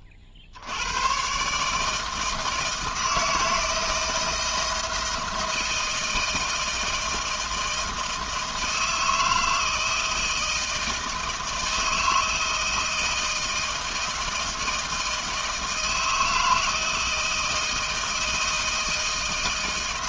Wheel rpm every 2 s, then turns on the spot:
60, 160, 160, 160, 160, 160, 160, 160, 160, 160.
none